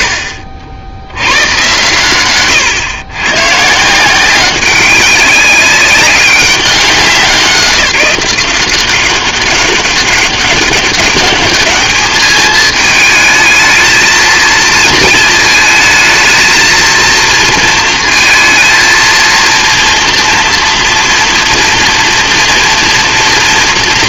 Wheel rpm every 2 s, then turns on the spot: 70, 120, 190, 200, 180, 200, 220, 220, 220, 230, 230, 230.
none